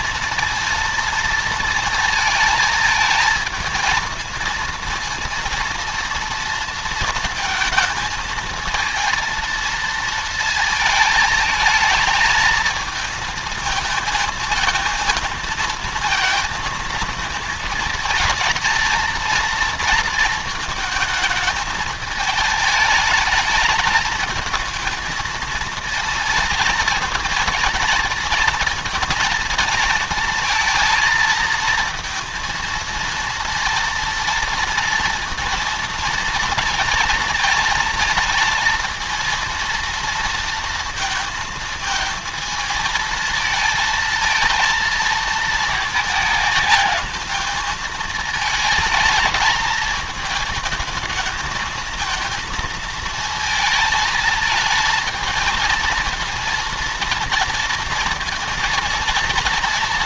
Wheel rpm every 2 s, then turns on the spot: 230, 220, 230, 230, 230, 230, 220, 230, 230, 220, 230, 220, 220, 230, 230, 230, 230, 230, 230, 230, 230, 220, 230, 220, 220, 220, 230, 220, 230, 230.
none